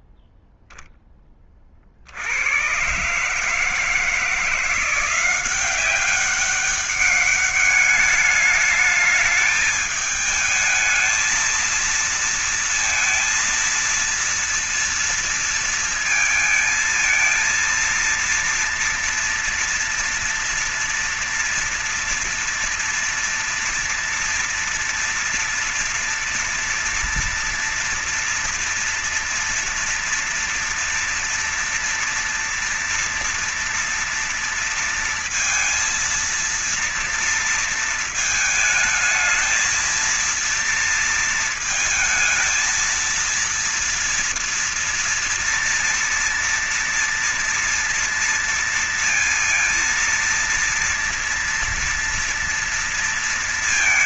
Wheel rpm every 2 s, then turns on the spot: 0, 100, 170, 200, 210, 210, 230, 230, 220, 230, 230, 230, 230, 230, 230, 230, 230, 230, 230, 220, 230, 220, 230, 240, 230, 230, 230.
none